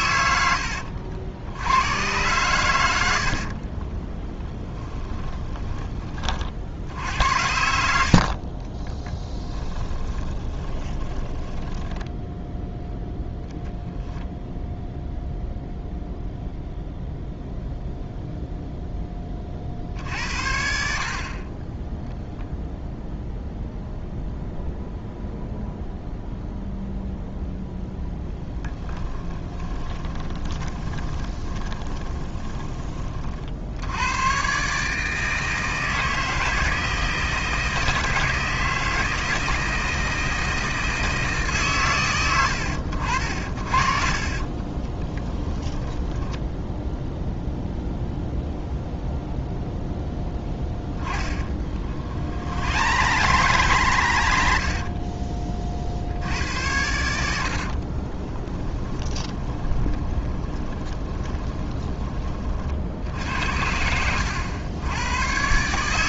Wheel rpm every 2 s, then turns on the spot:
70, 90, 10, 60, 20, 20, 10, 0, 0, 10, 70, 0, 0, 0, 10, 20, 40, 150, 160, 160, 160, 80, 20, 0, 0, 10, 90, 30, 90, 20, 20, 60, 100.
2-6 8-12 28-32 44-46 50-54 58-62